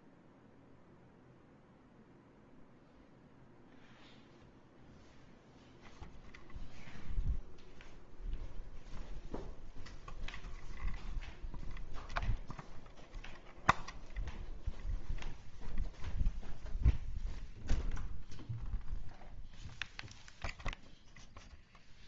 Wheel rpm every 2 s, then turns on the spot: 0, 0, 0, 0, 0, 0, 0, 0, 0, 0, 0.
none